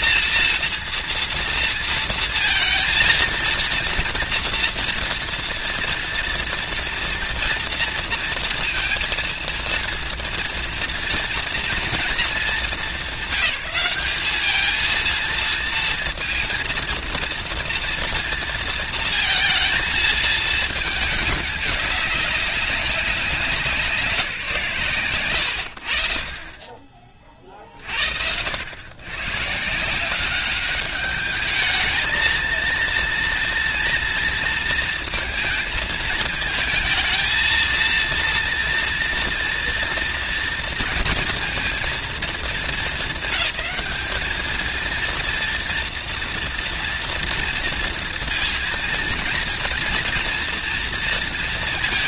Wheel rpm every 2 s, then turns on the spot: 230, 230, 240, 240, 230, 230, 200, 210, 230, 230, 220, 200, 170, 40, 80, 200, 220, 230, 220, 230, 230, 210, 210, 240, 230, 230.
none